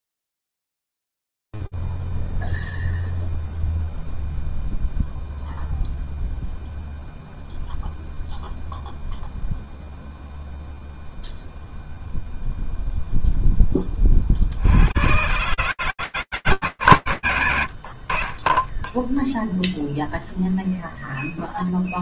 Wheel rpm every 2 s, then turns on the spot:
0, 0, 0, 0, 0, 0, 10, 140, 120, 0, 0.
none